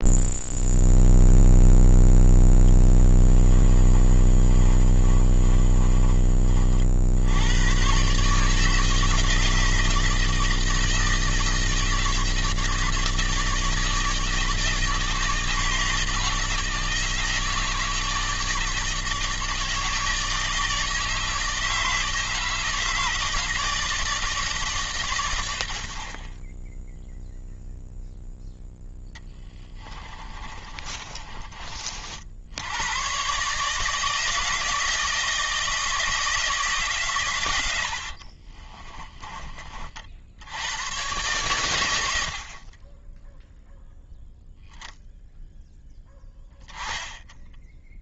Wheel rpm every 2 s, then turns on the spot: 0, 10, 30, 60, 160, 160, 160, 160, 160, 150, 160, 160, 140, 10, 10, 30, 90, 160, 150, 20, 110, 20, 10, 10.
2-6 30-32 38-40